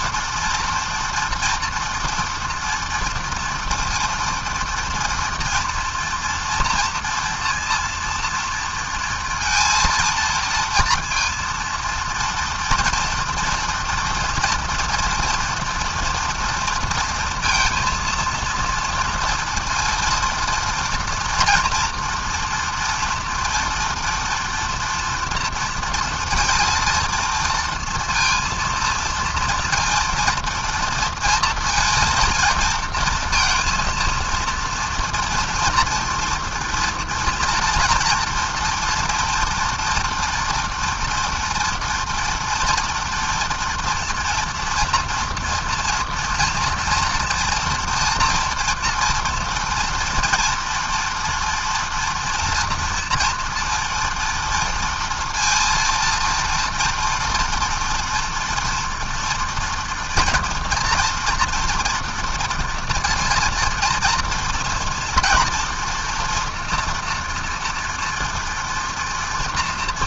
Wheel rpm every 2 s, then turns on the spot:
240, 230, 230, 230, 230, 230, 230, 230, 230, 230, 240, 230, 230, 230, 230, 230, 230, 230, 230, 230, 230, 230, 240, 230, 240, 230, 230, 230, 240, 230, 230, 230, 230, 240, 230.
none